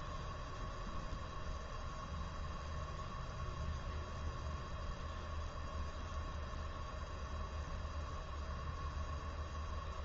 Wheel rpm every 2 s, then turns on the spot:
0, 0, 0, 0, 0.
none